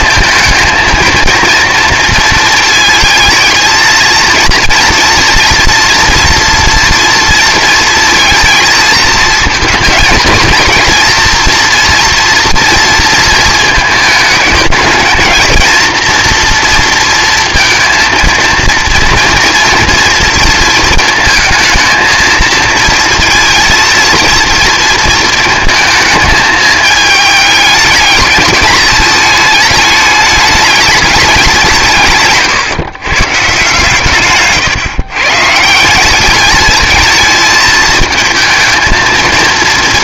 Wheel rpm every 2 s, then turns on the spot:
230, 230, 230, 230, 230, 230, 230, 220, 230, 230, 230, 230, 230, 220, 210, 210, 120, 150, 220, 230.
34-36